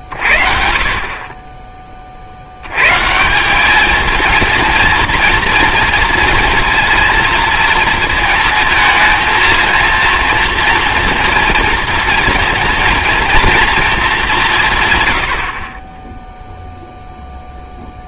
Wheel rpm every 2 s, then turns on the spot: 30, 100, 230, 230, 220, 240, 230, 150, 0.
none